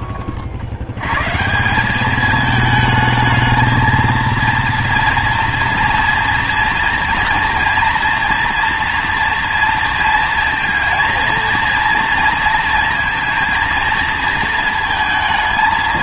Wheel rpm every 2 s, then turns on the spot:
70, 220, 230, 230, 230, 230, 230, 230.
none